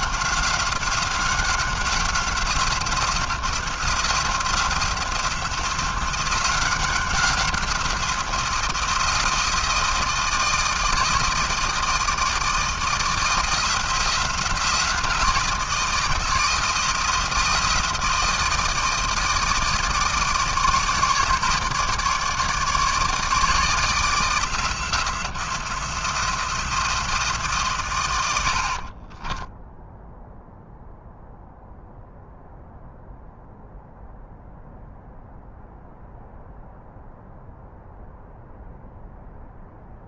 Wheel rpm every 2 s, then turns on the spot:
190, 180, 180, 180, 170, 160, 160, 170, 170, 160, 160, 150, 170, 170, 80, 0, 0, 0, 0, 0.
none